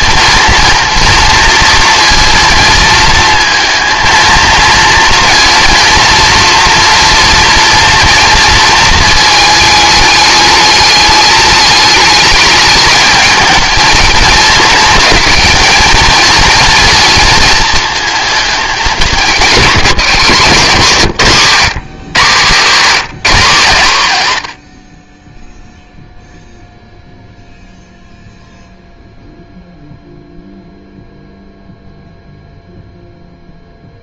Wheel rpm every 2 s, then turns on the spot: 230, 230, 230, 230, 220, 210, 220, 220, 230, 200, 150, 160, 50, 0, 0, 0, 0.
none